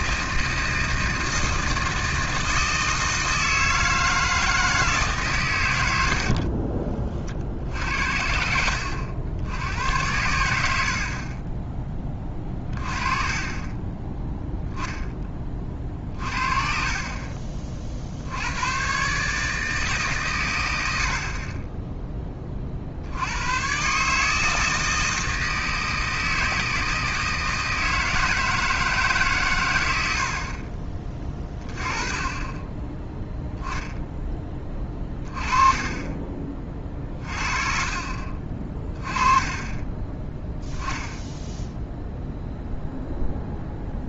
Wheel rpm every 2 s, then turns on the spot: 160, 160, 160, 30, 70, 70, 30, 10, 40, 110, 90, 50, 160, 160, 160, 40, 10, 20, 30, 30, 0, 0.
6-8 10-12 36-38